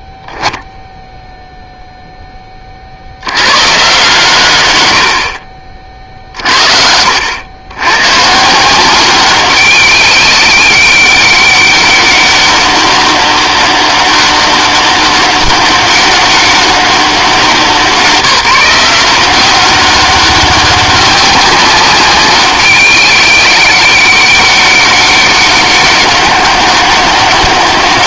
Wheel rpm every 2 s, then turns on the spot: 0, 30, 100, 50, 170, 190, 200, 200, 190, 170, 190, 200, 190, 200.
none